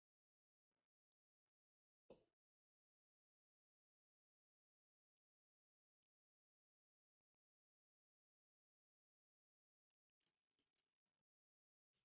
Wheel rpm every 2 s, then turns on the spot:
0, 0, 0, 0, 0, 0.
none